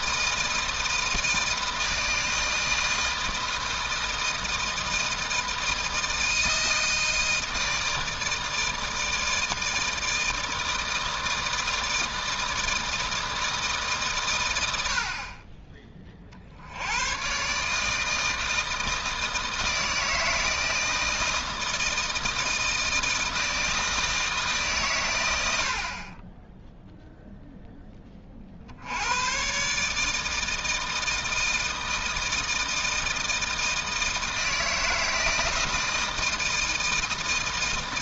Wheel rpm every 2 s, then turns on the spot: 160, 160, 160, 160, 160, 160, 160, 90, 90, 160, 160, 160, 130, 0, 70, 160, 160, 160, 160.
none